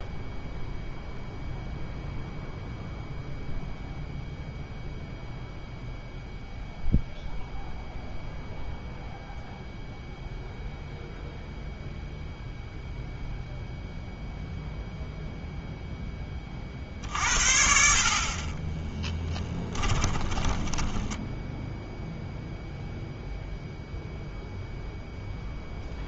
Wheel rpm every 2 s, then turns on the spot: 0, 0, 0, 0, 0, 0, 0, 0, 40, 10, 10, 0, 0.
18-22